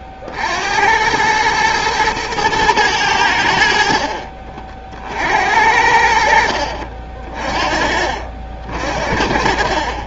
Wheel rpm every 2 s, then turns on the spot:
90, 110, 50, 50, 60.
none